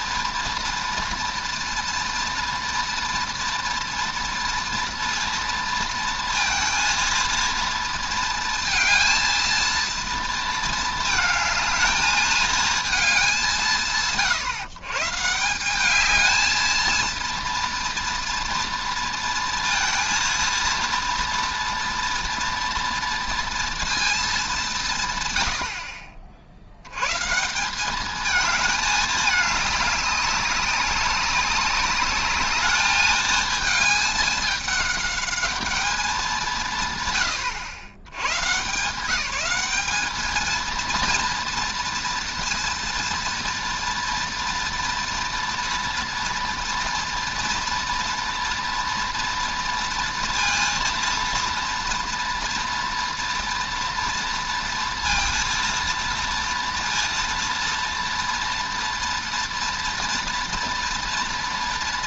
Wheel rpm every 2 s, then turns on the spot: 230, 230, 230, 230, 230, 220, 220, 130, 220, 230, 230, 230, 180, 90, 220, 190, 210, 210, 150, 140, 230, 230, 240, 230, 230, 230, 240, 230, 230, 230, 230.
none